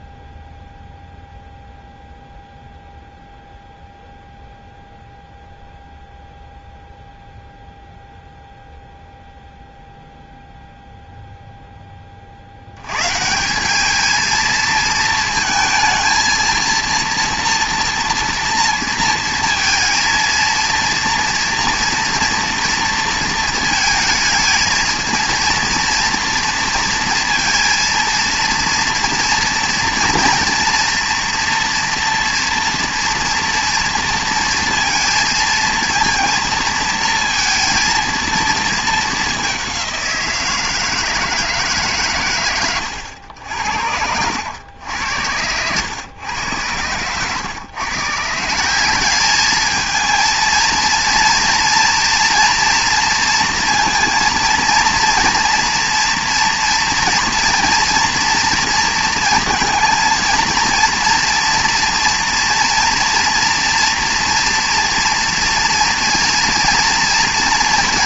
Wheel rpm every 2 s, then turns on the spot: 0, 0, 0, 0, 0, 0, 80, 230, 230, 230, 230, 230, 230, 230, 230, 240, 240, 230, 230, 220, 160, 120, 90, 110, 170, 230, 230, 230, 230, 230, 230, 230, 230, 230.
none